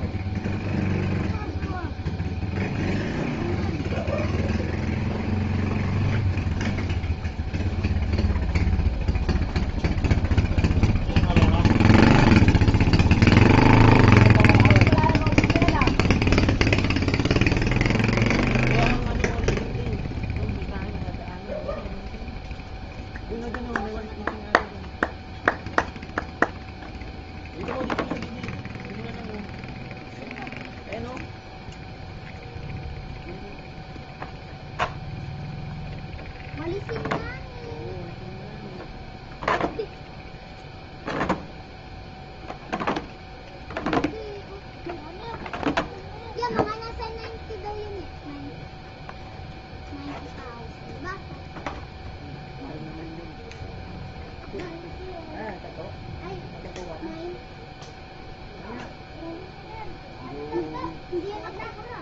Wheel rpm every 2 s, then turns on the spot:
0, 0, 0, 0, 0, 0, 0, 0, 0, 0, 0, 0, 0, 0, 0, 0, 0, 0, 0, 0, 0, 0, 0, 0, 0, 0, 0, 0, 0, 0, 0.
none